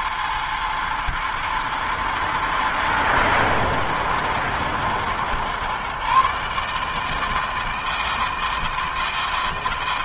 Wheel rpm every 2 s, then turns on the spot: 110, 110, 120, 140, 160.
none